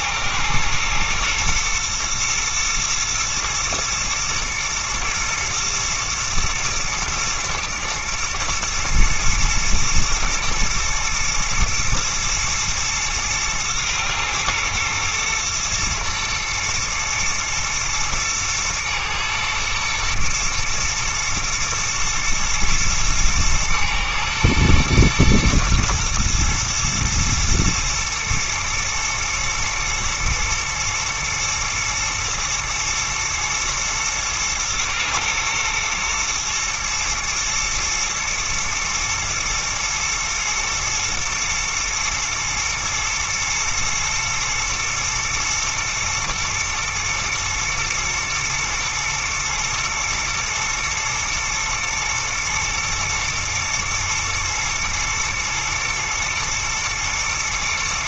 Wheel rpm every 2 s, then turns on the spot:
110, 110, 110, 110, 120, 110, 110, 120, 120, 110, 120, 120, 110, 120, 110, 120, 110, 110, 120, 110, 120, 120, 110, 110, 110, 120, 120, 110, 120.
none